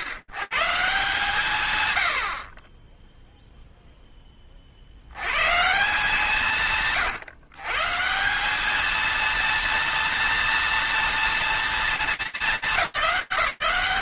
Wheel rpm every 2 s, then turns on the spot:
130, 50, 20, 140, 180, 230, 190.
none